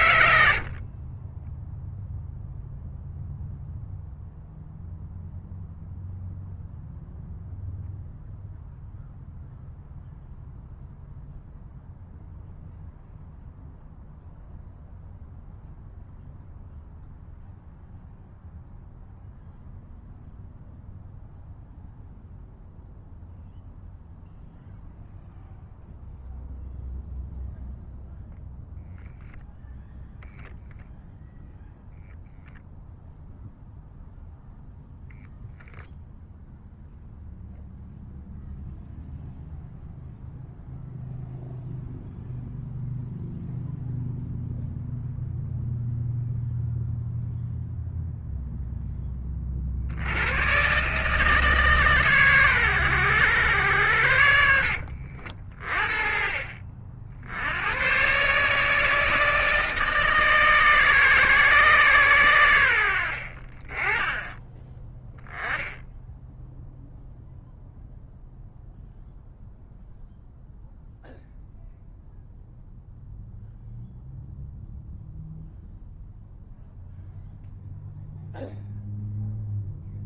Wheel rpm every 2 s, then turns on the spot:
40, 0, 0, 0, 0, 0, 0, 0, 0, 0, 0, 0, 0, 0, 0, 0, 0, 0, 0, 0, 0, 0, 0, 0, 0, 130, 110, 60, 50, 150, 150, 80, 10, 0, 0, 0, 0, 0, 0, 0.
none